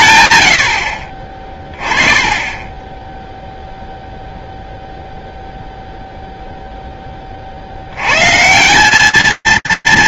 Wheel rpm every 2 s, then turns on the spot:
40, 0, 0, 80, 230.
none